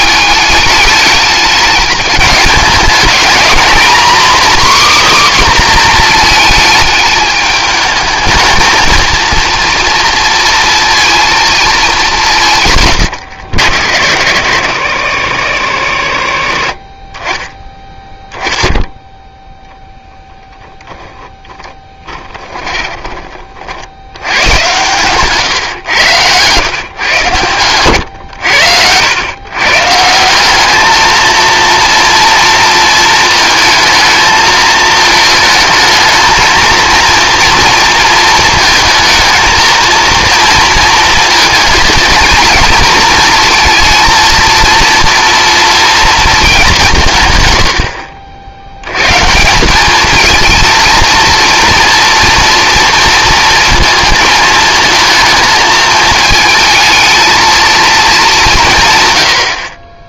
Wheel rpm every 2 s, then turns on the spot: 210, 210, 280, 220, 220, 230, 140, 100, 40, 0, 0, 30, 130, 130, 90, 200, 230, 220, 230, 220, 230, 230, 230, 170, 100, 230, 230, 220, 220, 150.
22-24